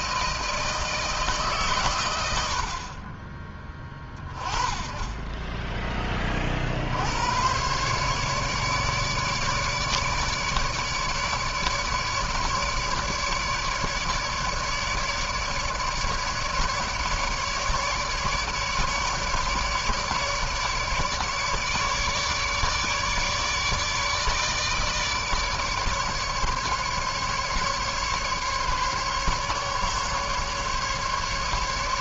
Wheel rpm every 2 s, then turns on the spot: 160, 80, 20, 30, 140, 150, 150, 150, 150, 150, 150, 150, 150, 150, 150, 140.
none